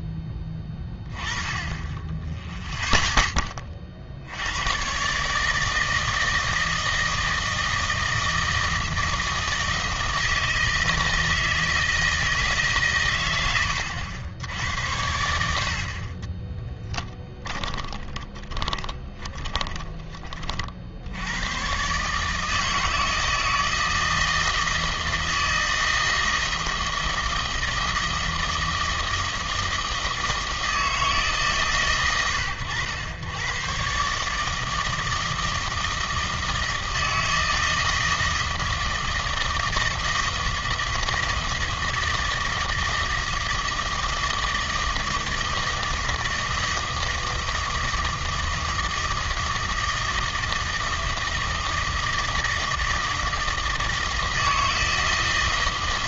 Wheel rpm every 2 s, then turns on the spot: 20, 30, 100, 160, 160, 160, 140, 80, 10, 20, 50, 160, 160, 160, 160, 160, 110, 160, 160, 160, 160, 160, 160, 160, 160, 160, 160, 160.
16-20